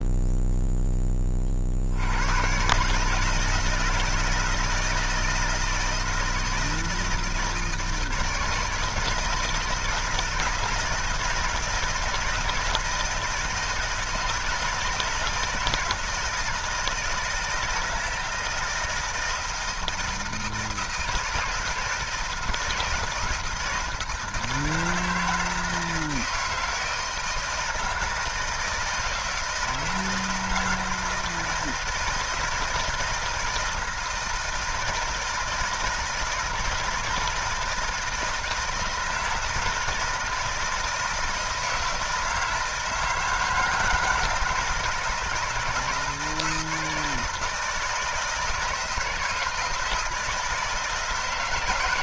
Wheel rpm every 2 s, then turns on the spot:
0, 130, 160, 160, 160, 160, 160, 170, 160, 160, 160, 160, 160, 160, 160, 160, 170, 160, 160, 160, 160, 160, 160, 160, 160, 160.
none